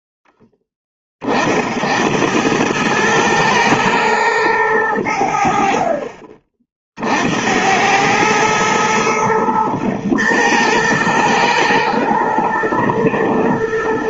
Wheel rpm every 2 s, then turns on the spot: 20, 100, 100, 50, 110, 110, 110.
none